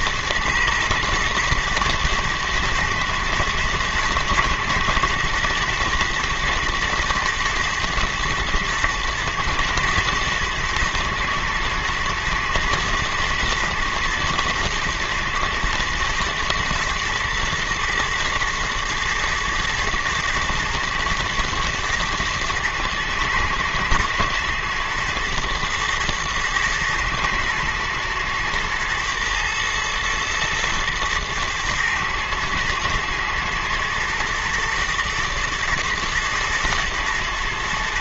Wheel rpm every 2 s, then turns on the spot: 120, 120, 120, 120, 110, 110, 120, 120, 120, 110, 110, 120, 110, 110, 120, 110, 110, 110, 110.
none